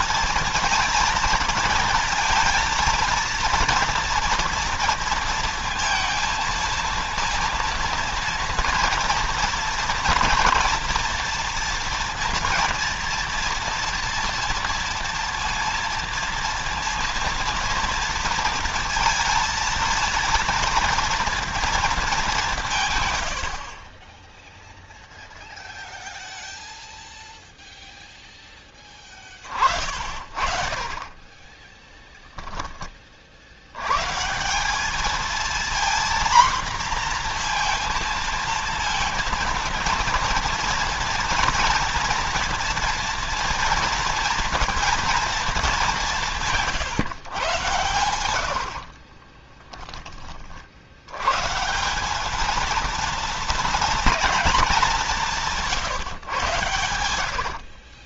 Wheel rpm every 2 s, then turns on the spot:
230, 230, 230, 230, 230, 230, 230, 230, 230, 230, 230, 150, 0, 0, 20, 30, 30, 210, 250, 230, 240, 230, 230, 150, 50, 70, 230, 200, 110.
48-50 56-58